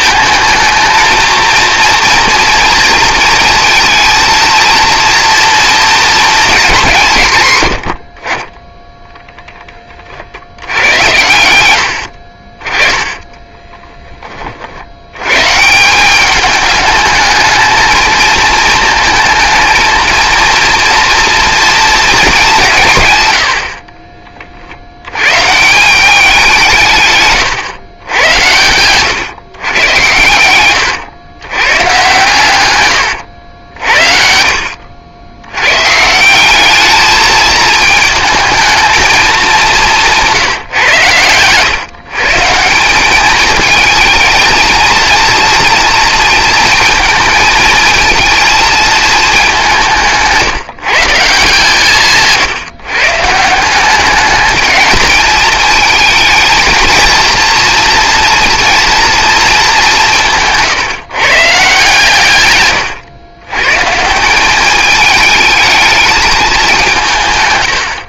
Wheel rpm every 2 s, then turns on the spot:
220, 230, 230, 200, 10, 70, 40, 40, 210, 220, 230, 190, 40, 180, 90, 100, 120, 60, 190, 220, 150, 160, 220, 230, 220, 160, 140, 210, 220, 230, 150, 110, 190, 200.
none